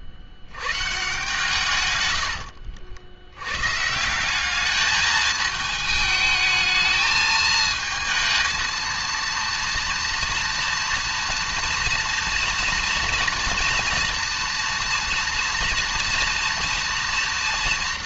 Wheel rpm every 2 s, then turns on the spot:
100, 90, 210, 220, 230, 230, 230, 230, 230.
2-4